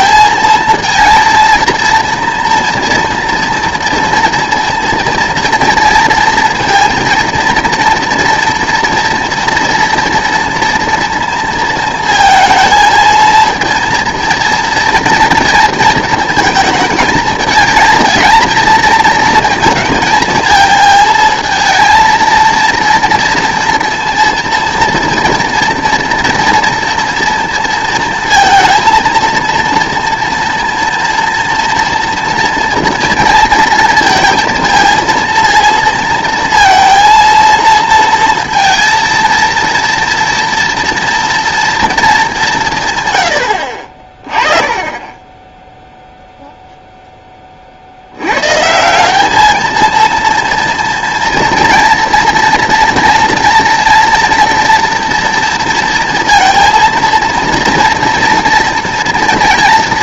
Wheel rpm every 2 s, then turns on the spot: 230, 230, 230, 230, 230, 230, 220, 230, 220, 230, 220, 230, 230, 230, 230, 240, 230, 230, 230, 230, 230, 170, 20, 0, 150, 230, 230, 240, 230, 230.
none